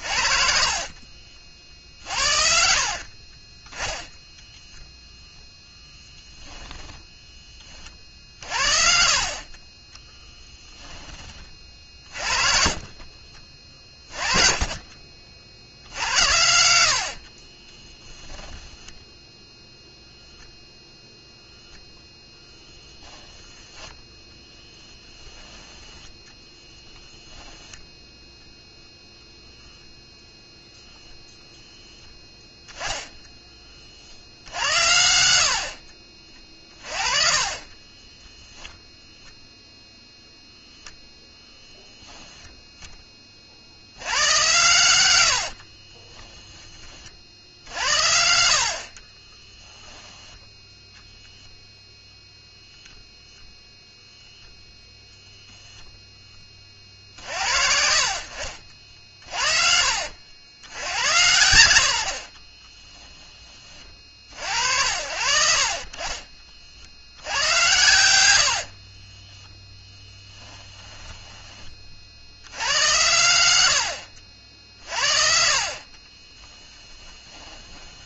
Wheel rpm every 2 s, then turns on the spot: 50, 60, 0, 10, 50, 20, 40, 40, 80, 10, 0, 10, 10, 10, 0, 0, 10, 80, 30, 0, 0, 10, 110, 20, 50, 0, 0, 0, 50, 50, 90, 20, 80, 60, 50, 10, 110, 50, 10.
0-4 10-12 18-20 48-50 58-60 62-64 68-72 76-78